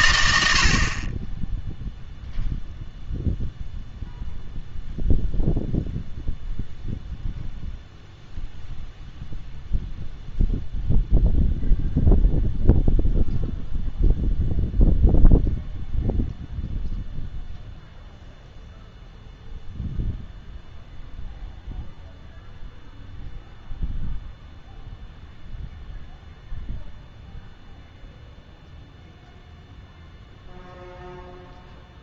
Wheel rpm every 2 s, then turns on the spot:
60, 0, 0, 0, 0, 0, 0, 0, 0, 0, 0, 0, 0, 0, 0, 0.
none